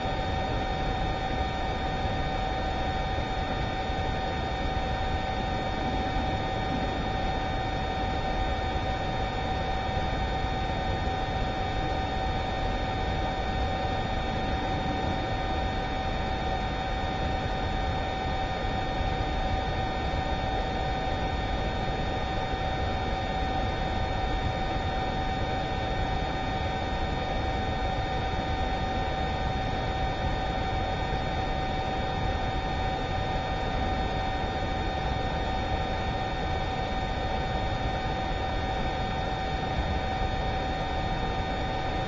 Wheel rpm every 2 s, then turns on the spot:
0, 0, 0, 0, 0, 0, 0, 0, 0, 0, 0, 0, 0, 0, 0, 0, 0, 0, 0, 0, 0.
none